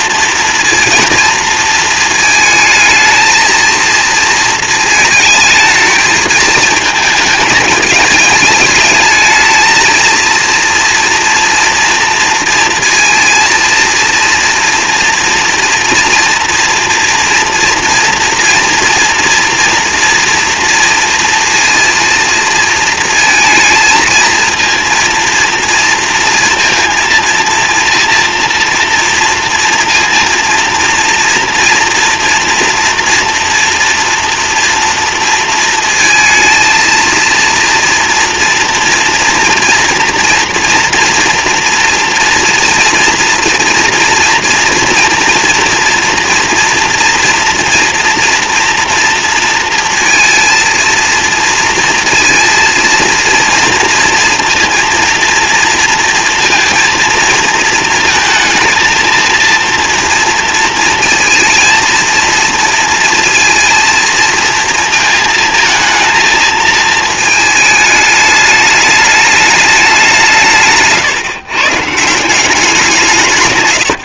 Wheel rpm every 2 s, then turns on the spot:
230, 220, 220, 220, 210, 230, 230, 240, 230, 230, 230, 230, 230, 230, 230, 230, 240, 230, 230, 230, 240, 230, 230, 240, 230, 230, 230, 230, 230, 230, 230, 230, 230, 220, 210, 150, 180.
70-72